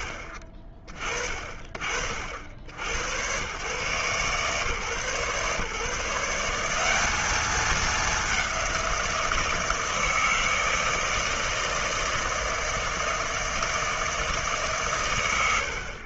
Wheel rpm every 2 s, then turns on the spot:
30, 80, 140, 190, 170, 160, 160, 130.
none